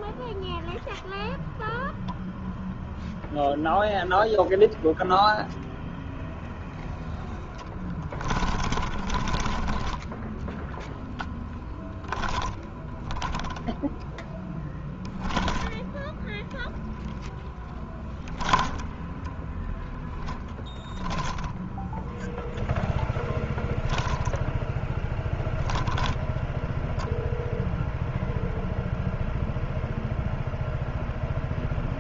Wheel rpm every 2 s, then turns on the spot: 10, 0, 0, 0, 20, 0, 0, 0, 0, 10, 10, 0, 0, 0, 0, 0.
none